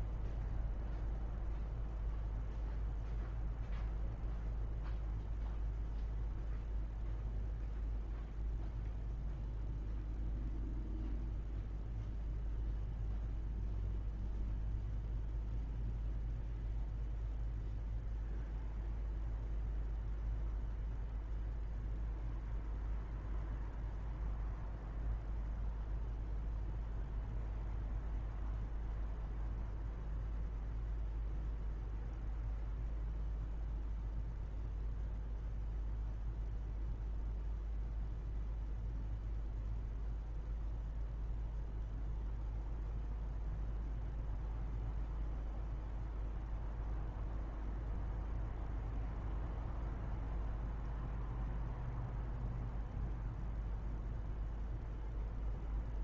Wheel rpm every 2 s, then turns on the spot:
0, 0, 0, 0, 0, 0, 0, 0, 0, 0, 0, 0, 0, 0, 0, 0, 0, 0, 0, 0, 0, 0, 0, 0, 0, 0, 0, 0.
none